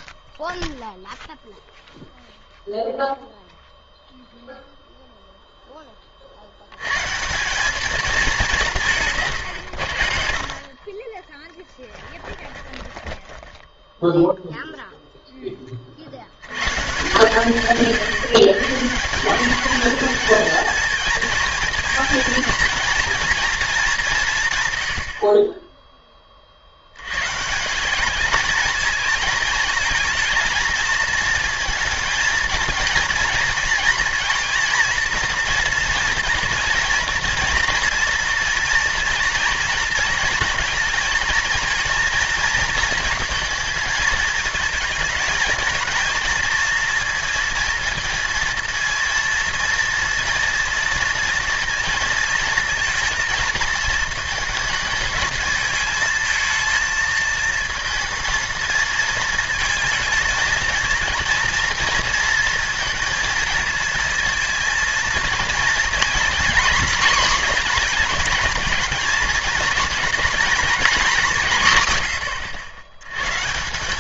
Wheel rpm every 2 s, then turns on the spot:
0, 0, 0, 100, 170, 40, 10, 0, 130, 160, 230, 230, 130, 60, 220, 220, 220, 230, 220, 230, 230, 230, 230, 230, 230, 230, 230, 220, 220, 230, 220, 220, 230, 250, 220, 230, 100.
12-14